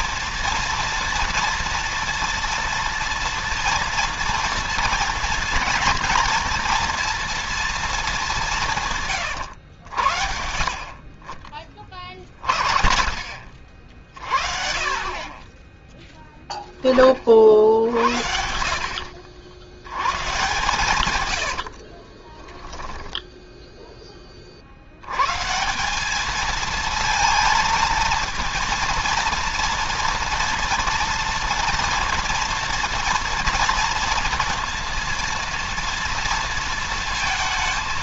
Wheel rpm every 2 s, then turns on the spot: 230, 230, 230, 230, 170, 60, 40, 30, 20, 70, 130, 10, 80, 220, 230, 230, 230, 230, 230.
20-24